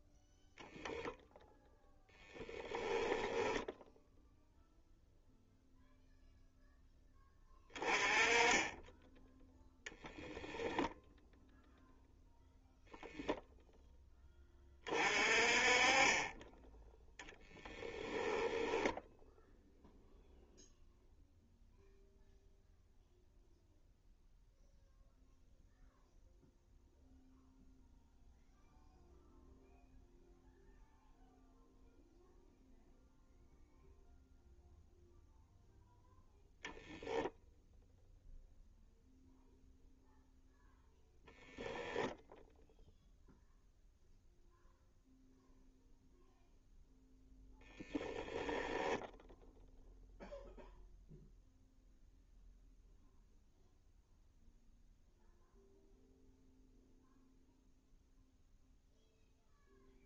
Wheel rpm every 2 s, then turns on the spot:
10, 10, 0, 10, 10, 0, 0, 30, 10, 10, 0, 0, 0, 0, 0, 0, 0, 0, 0, 0, 0, 0, 0, 0, 10, 0, 0, 0, 0, 0.
2-4 14-20